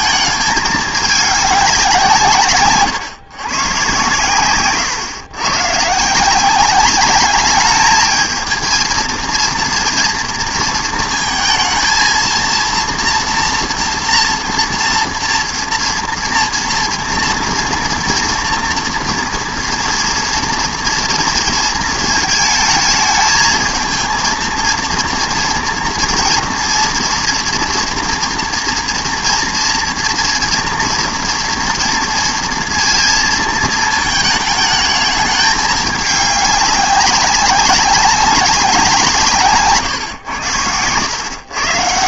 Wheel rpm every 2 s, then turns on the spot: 220, 150, 120, 180, 220, 230, 230, 230, 230, 230, 230, 220, 230, 230, 230, 230, 230, 220, 200, 190, 110.
none